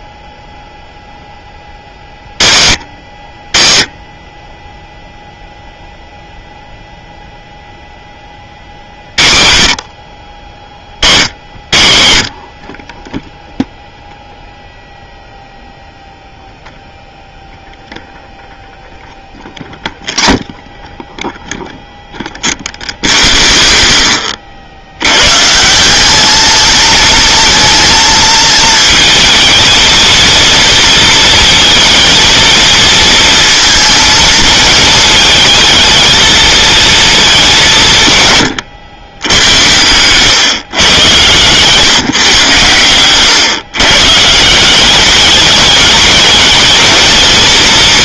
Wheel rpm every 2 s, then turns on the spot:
0, 60, 20, 0, 50, 60, 50, 0, 0, 0, 0, 0, 50, 220, 220, 230, 230, 230, 220, 120, 120, 120, 180, 230.
none